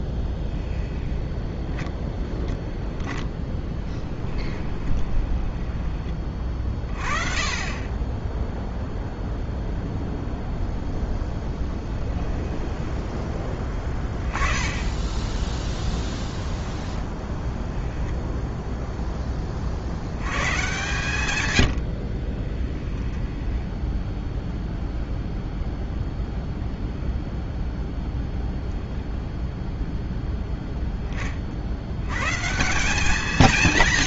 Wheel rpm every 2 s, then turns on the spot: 10, 0, 10, 30, 0, 0, 10, 20, 10, 0, 140, 20, 0, 0, 0, 10, 170.
0-2 4-6 12-14 16-18 22-24